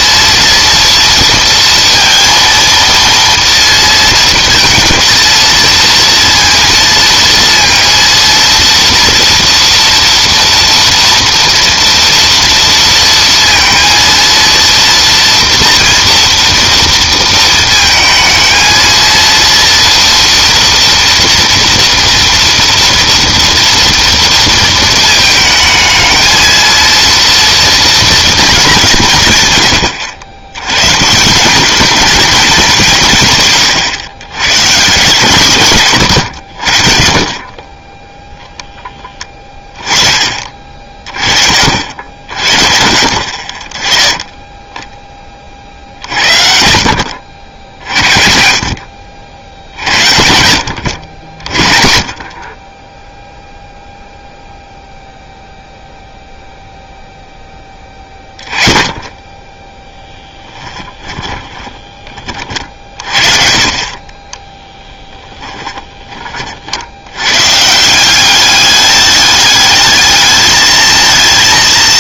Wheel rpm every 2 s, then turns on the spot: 230, 230, 230, 230, 230, 230, 230, 230, 230, 230, 240, 230, 230, 220, 230, 100, 220, 120, 110, 10, 40, 50, 10, 60, 60, 80, 20, 0, 0, 10, 20, 40, 10, 50, 200, 220.
60-62 64-66